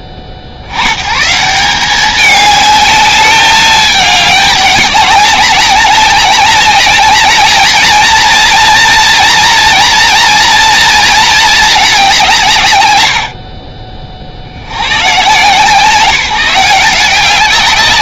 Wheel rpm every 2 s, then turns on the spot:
60, 210, 200, 200, 230, 230, 120, 100, 180.
none